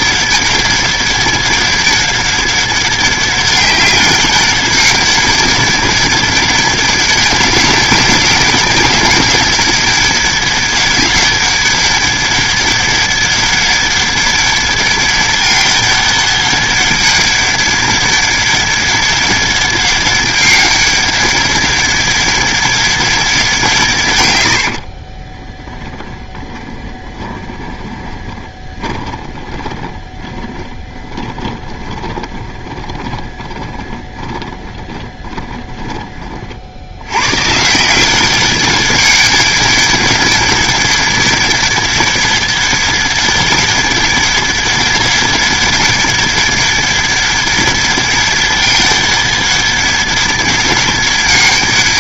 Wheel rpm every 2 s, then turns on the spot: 200, 200, 200, 200, 200, 200, 200, 200, 200, 200, 200, 200, 60, 20, 20, 20, 20, 20, 80, 200, 200, 200, 200, 190, 200, 200.
24-36